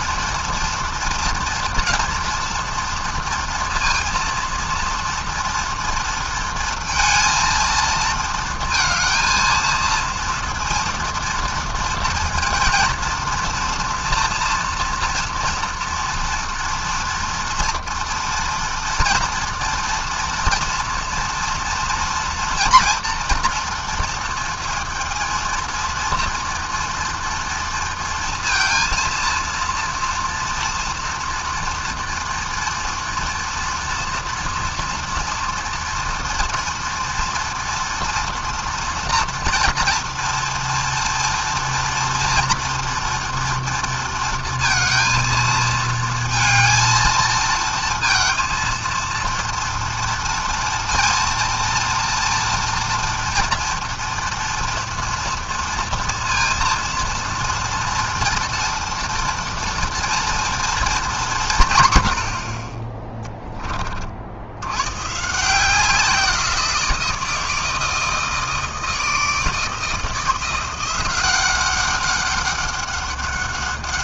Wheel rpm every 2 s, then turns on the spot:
230, 230, 230, 230, 230, 230, 230, 230, 230, 230, 240, 230, 230, 230, 230, 230, 230, 230, 230, 230, 240, 230, 220, 220, 230, 230, 230, 230, 240, 230, 200, 10, 150, 160, 160, 190, 190.
none